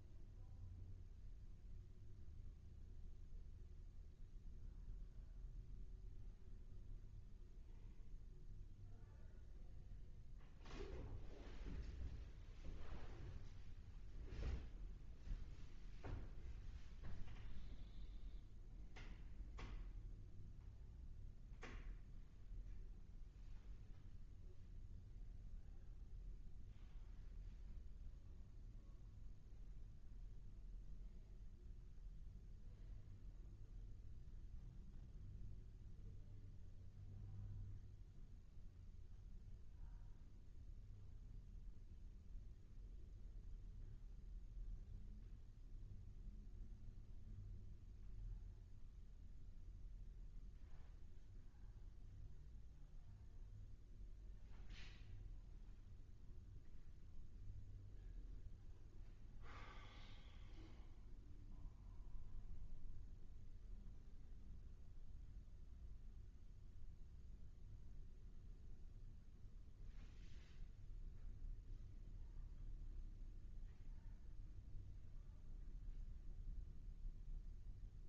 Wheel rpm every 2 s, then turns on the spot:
0, 0, 0, 0, 0, 0, 0, 0, 0, 0, 0, 0, 0, 0, 0, 0, 0, 0, 0, 0, 0, 0, 0, 0, 0, 0, 0, 0, 0, 0, 0, 0, 0, 0, 0, 0, 0, 0, 0.
none